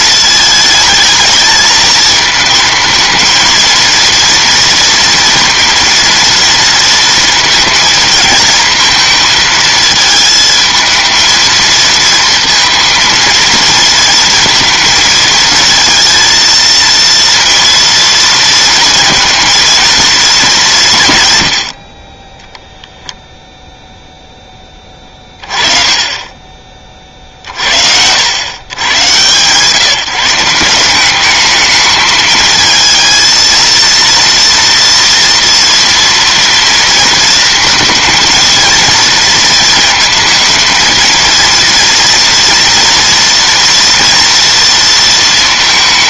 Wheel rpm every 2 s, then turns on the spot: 220, 220, 240, 230, 220, 220, 230, 230, 230, 230, 180, 0, 10, 30, 120, 180, 220, 230, 230, 230, 220, 230, 230.
none